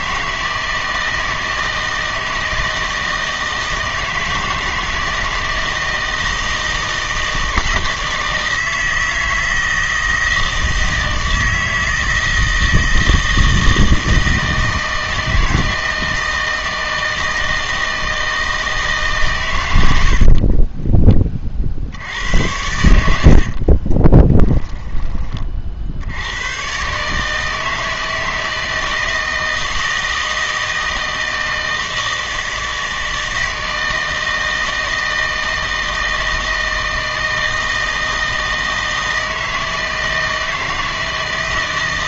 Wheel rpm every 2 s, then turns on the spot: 160, 160, 160, 160, 160, 160, 160, 160, 160, 160, 40, 80, 20, 110, 160, 160, 160, 160, 160, 160, 160.
20-26